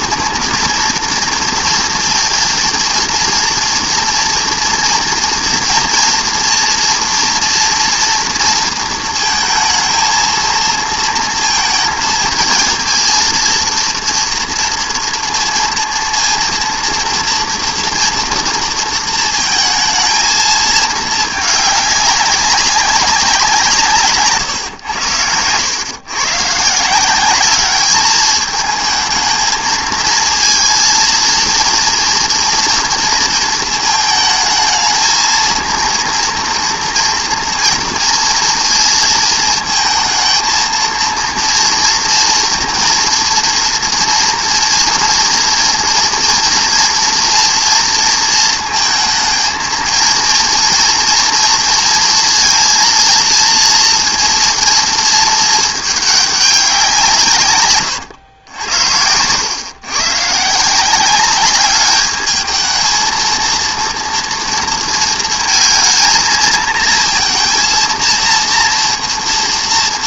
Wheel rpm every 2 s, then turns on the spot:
230, 230, 230, 230, 230, 230, 230, 230, 230, 230, 220, 190, 100, 180, 220, 230, 230, 220, 240, 230, 230, 230, 230, 230, 230, 230, 230, 220, 160, 90, 190, 220, 230, 230, 230.
none